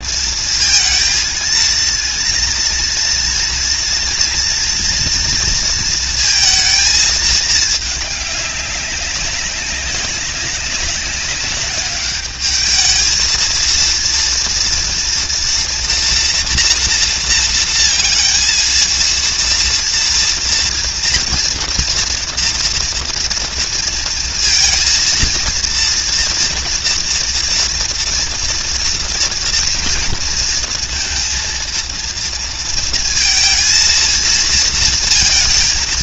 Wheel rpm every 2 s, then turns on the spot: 230, 230, 230, 230, 210, 190, 200, 230, 230, 230, 230, 230, 230, 230, 230, 230, 230, 230.
none